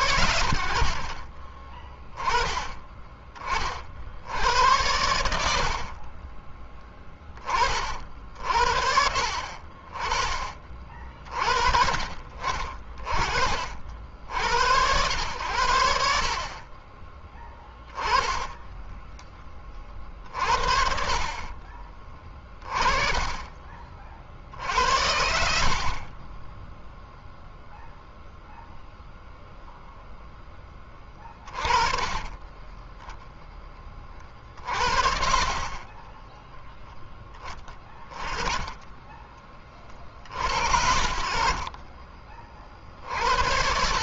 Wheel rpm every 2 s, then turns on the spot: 60, 20, 80, 10, 70, 40, 40, 80, 20, 10, 50, 20, 80, 0, 0, 20, 10, 50, 0, 10, 50, 50.
16-18